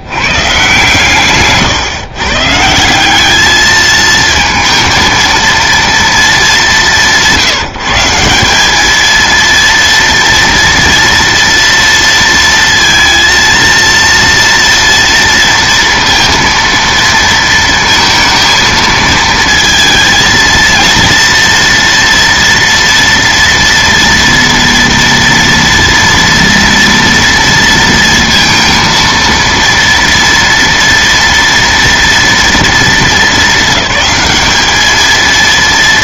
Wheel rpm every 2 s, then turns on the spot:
120, 150, 230, 210, 190, 230, 230, 230, 230, 220, 230, 230, 240, 230, 230, 230, 240, 210.
none